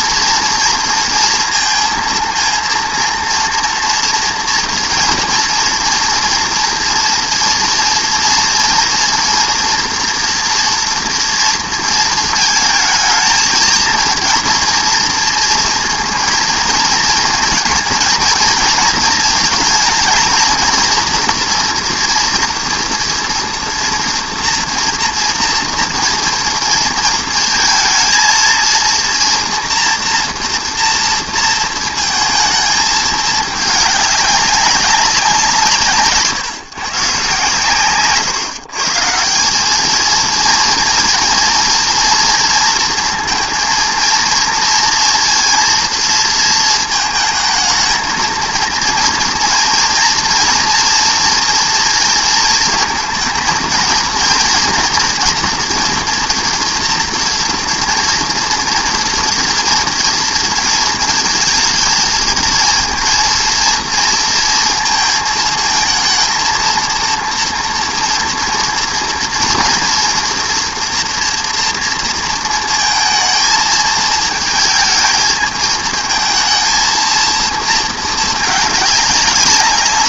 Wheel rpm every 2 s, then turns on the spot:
230, 230, 230, 230, 230, 230, 230, 220, 230, 230, 220, 240, 240, 230, 230, 240, 230, 210, 170, 130, 190, 230, 230, 230, 230, 230, 230, 230, 230, 230, 230, 230, 230, 220, 230, 230, 240, 220, 220, 230.
none